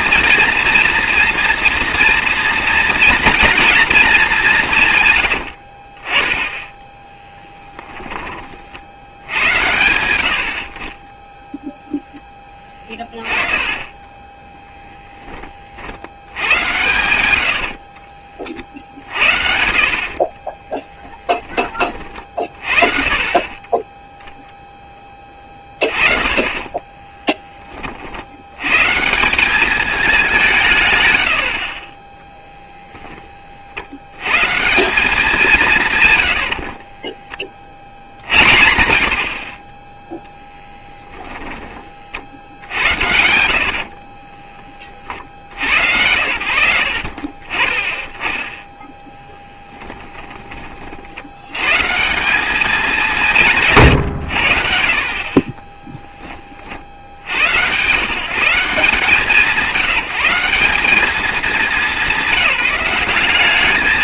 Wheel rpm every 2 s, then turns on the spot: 240, 230, 150, 10, 50, 40, 20, 10, 110, 50, 20, 30, 10, 20, 140, 140, 0, 170, 40, 70, 10, 80, 30, 40, 10, 40, 190, 60, 70, 160, 180, 180.
12-14 16-18 20-22 26-28 36-38 40-42